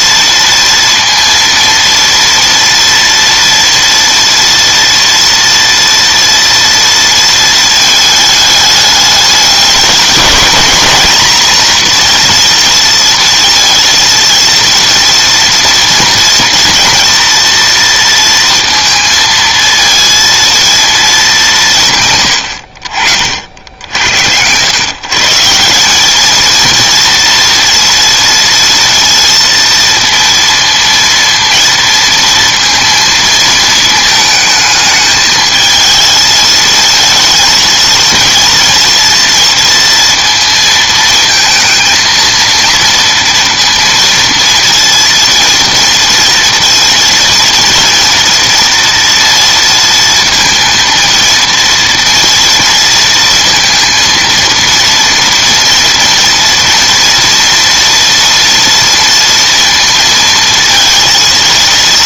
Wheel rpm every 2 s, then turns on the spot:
230, 230, 230, 230, 210, 220, 230, 230, 230, 230, 230, 70, 110, 230, 230, 230, 230, 220, 220, 230, 230, 230, 230, 230, 230, 230, 230, 230, 230, 230, 230.
none